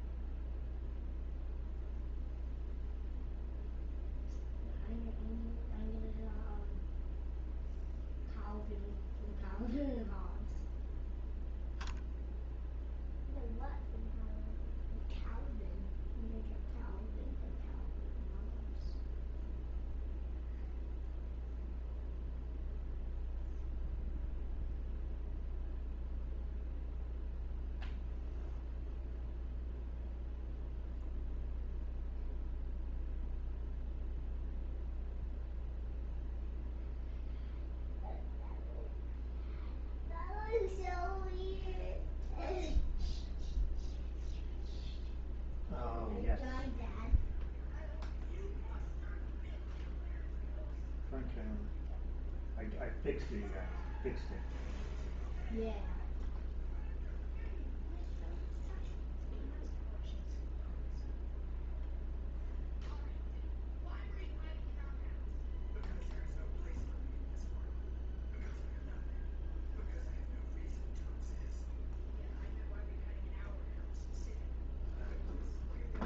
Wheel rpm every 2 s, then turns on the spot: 0, 0, 0, 0, 0, 0, 0, 0, 0, 0, 0, 0, 0, 0, 0, 0, 0, 0, 0, 0, 0, 0, 0, 0, 0, 0, 0, 0, 0, 0, 0, 0, 0, 0, 0, 0, 0, 0.
none